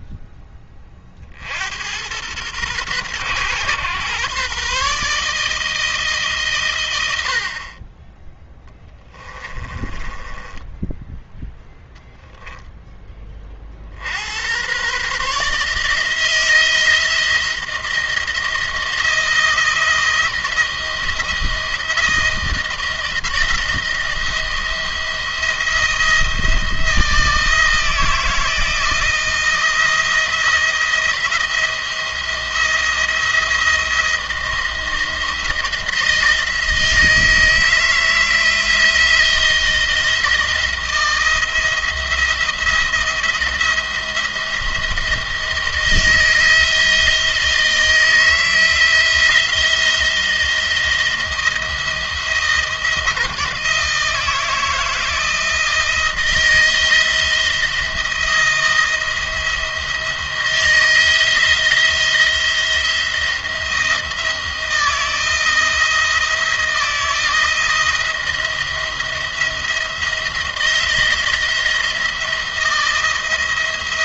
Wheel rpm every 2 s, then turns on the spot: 10, 110, 140, 120, 10, 10, 10, 120, 160, 170, 170, 170, 170, 170, 170, 170, 170, 170, 160, 160, 170, 170, 170, 160, 160, 170, 170, 160, 170, 170, 160, 170, 160, 160, 170, 170, 170.
8-12